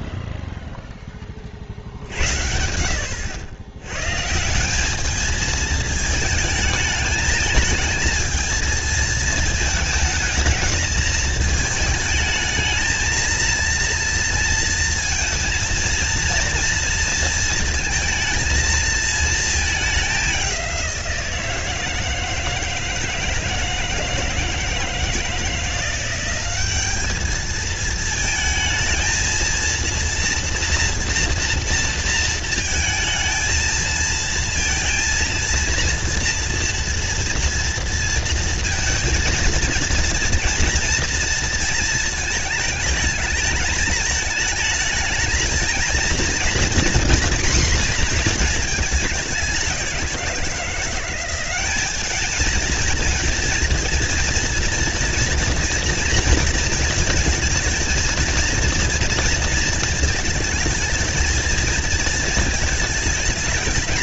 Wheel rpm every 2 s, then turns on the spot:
0, 80, 190, 210, 220, 210, 220, 230, 230, 220, 190, 160, 160, 200, 220, 230, 230, 230, 230, 230, 230, 220, 210, 240, 220, 180, 230, 230, 230, 230, 230, 220.
none